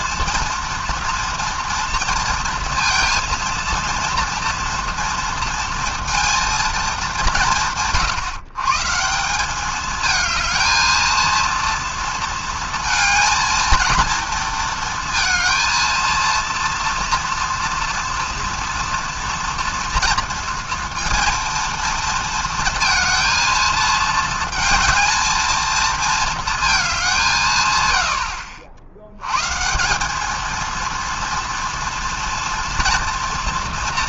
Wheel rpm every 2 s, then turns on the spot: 230, 230, 230, 220, 140, 220, 230, 230, 230, 230, 230, 230, 230, 210, 60, 230, 240.
none